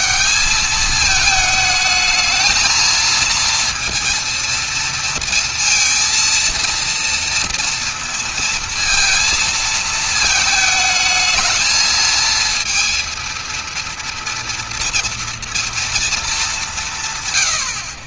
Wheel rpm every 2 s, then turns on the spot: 210, 220, 230, 230, 230, 220, 230, 230, 180.
none